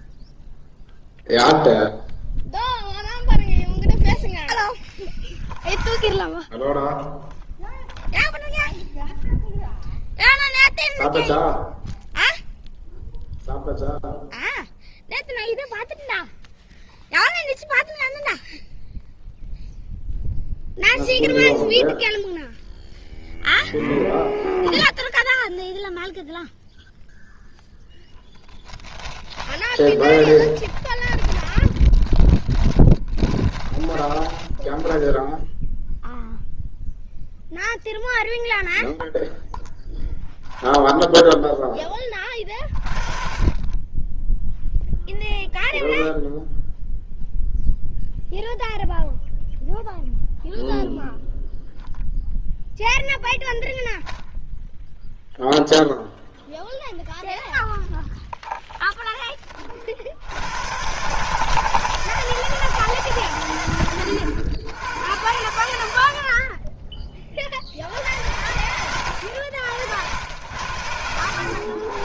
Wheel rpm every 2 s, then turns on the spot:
0, 0, 10, 10, 0, 0, 0, 0, 0, 0, 0, 0, 0, 0, 10, 20, 20, 10, 0, 0, 10, 30, 0, 0, 0, 0, 0, 0, 0, 0, 120, 160, 90, 20, 90, 100.
28-36